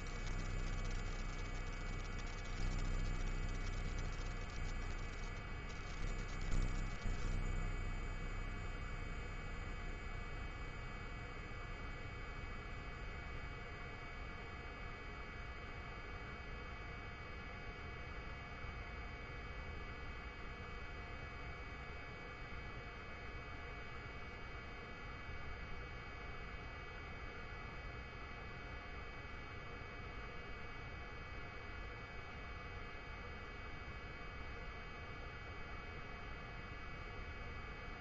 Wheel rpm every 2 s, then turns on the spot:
0, 0, 0, 0, 0, 0, 0, 0, 0, 0, 0, 0, 0, 0, 0, 0, 0, 0, 0.
none